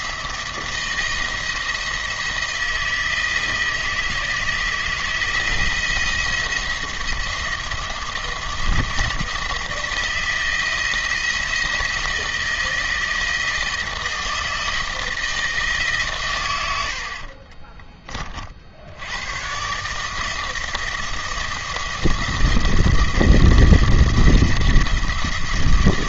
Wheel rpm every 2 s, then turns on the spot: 170, 160, 160, 170, 170, 170, 160, 160, 80, 60, 160, 170, 170.
none